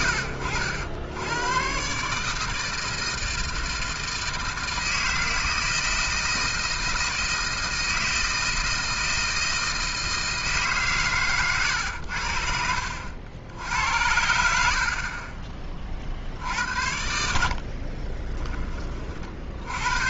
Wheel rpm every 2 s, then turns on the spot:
80, 160, 160, 160, 160, 150, 70, 80, 60, 20.
12-14